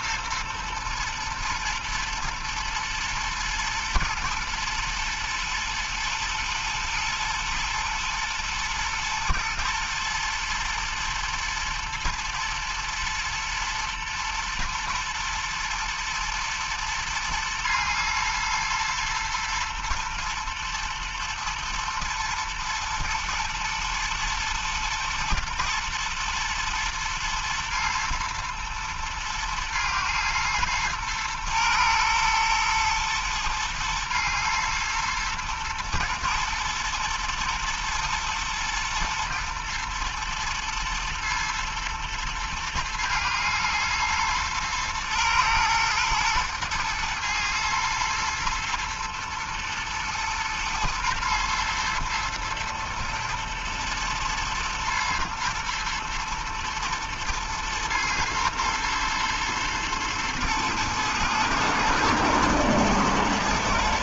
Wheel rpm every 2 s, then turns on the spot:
120, 110, 110, 110, 110, 120, 110, 110, 120, 110, 120, 110, 120, 110, 110, 110, 110, 120, 110, 120, 110, 120, 120, 120, 110, 110, 110, 110, 110, 110, 110, 120.
none